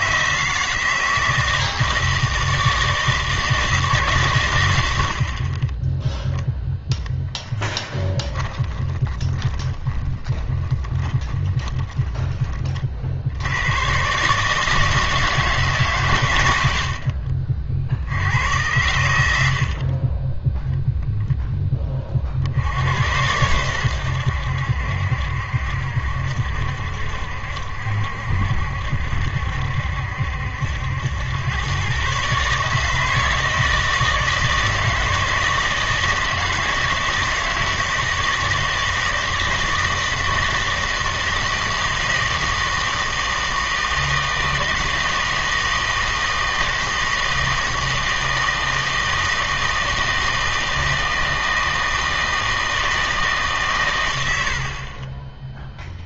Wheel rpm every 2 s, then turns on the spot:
160, 160, 90, 0, 20, 20, 40, 160, 70, 90, 0, 80, 70, 70, 70, 80, 150, 160, 160, 160, 160, 160, 160, 160, 160, 160, 160, 40.
8-12